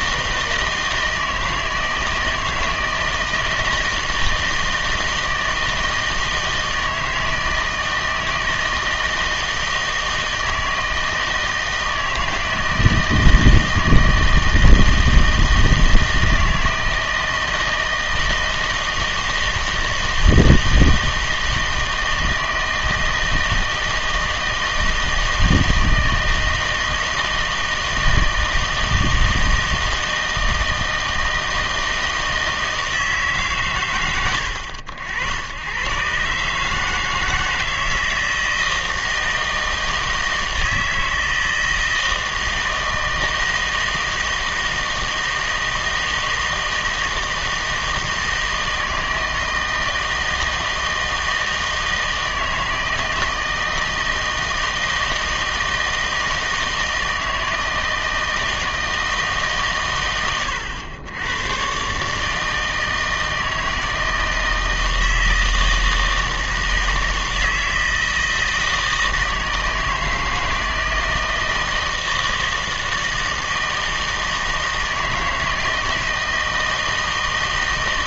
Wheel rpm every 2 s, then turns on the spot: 160, 160, 160, 160, 160, 160, 160, 160, 160, 160, 160, 160, 160, 160, 160, 160, 160, 90, 150, 160, 160, 160, 160, 160, 160, 160, 160, 160, 160, 160, 100, 160, 160, 160, 160, 160, 160, 160, 160.
none